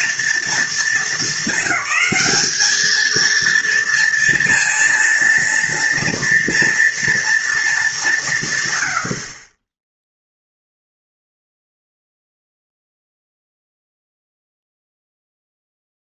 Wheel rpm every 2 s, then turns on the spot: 230, 220, 230, 230, 100, 0, 0, 0.
none